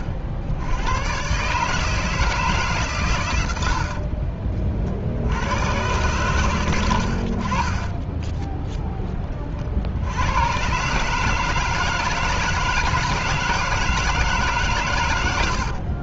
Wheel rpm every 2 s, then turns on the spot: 80, 150, 50, 110, 10, 110, 160, 140.
none